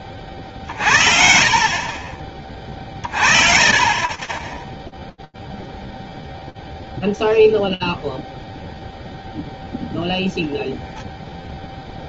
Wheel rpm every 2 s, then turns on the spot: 50, 40, 0, 0, 0, 0.
2-4